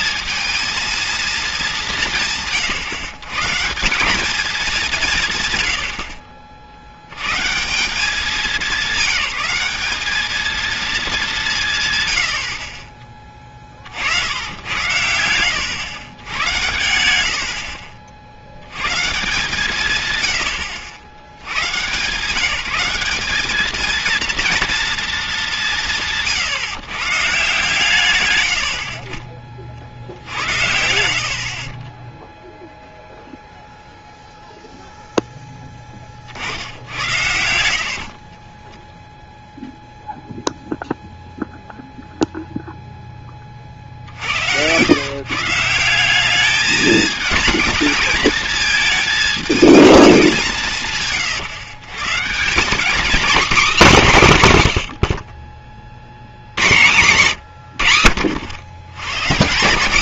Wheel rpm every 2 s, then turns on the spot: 220, 140, 200, 50, 200, 230, 60, 90, 100, 80, 80, 180, 230, 130, 90, 80, 0, 0, 70, 10, 0, 0, 110, 220, 220, 160, 200, 120, 110, 100.
16-18